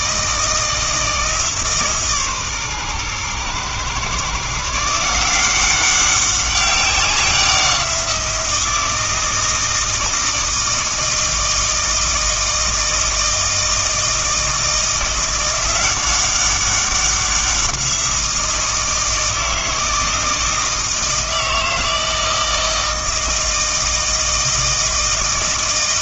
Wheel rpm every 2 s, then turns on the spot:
160, 130, 160, 190, 170, 160, 160, 170, 200, 160, 160, 160, 160.
none